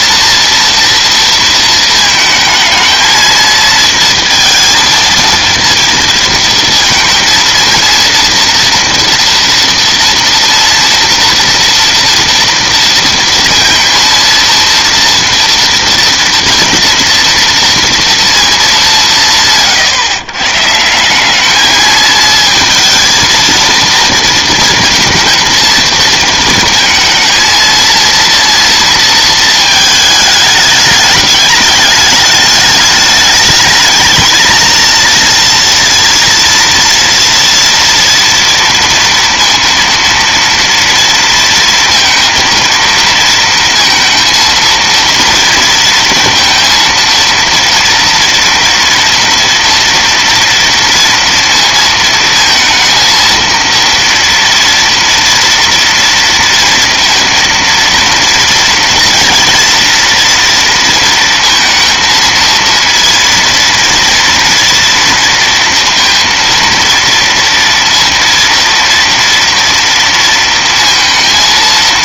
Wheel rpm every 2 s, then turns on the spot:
220, 230, 230, 230, 230, 230, 230, 230, 230, 130, 220, 230, 220, 230, 220, 210, 220, 230, 230, 230, 230, 230, 230, 230, 240, 230, 230, 230, 230, 240, 230, 230, 230, 230, 230, 230.
none